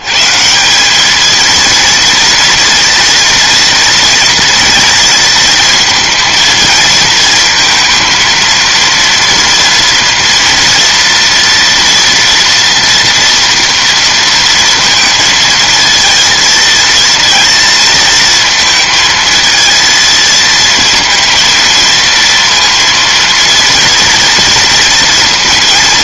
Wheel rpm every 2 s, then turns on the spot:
170, 230, 230, 230, 230, 230, 230, 230, 230, 230, 230, 230, 230.
none